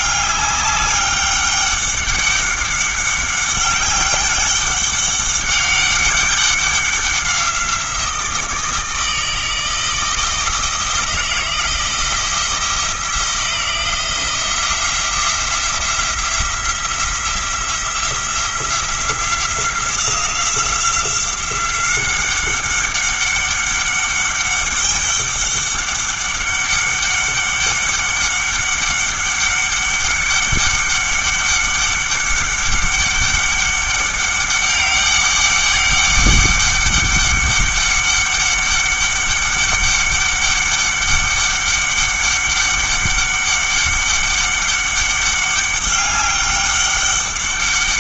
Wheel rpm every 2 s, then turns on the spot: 200, 200, 200, 190, 160, 160, 170, 170, 170, 170, 180, 200, 200, 200, 200, 200, 200, 200, 200, 200, 200, 200, 200, 200.
none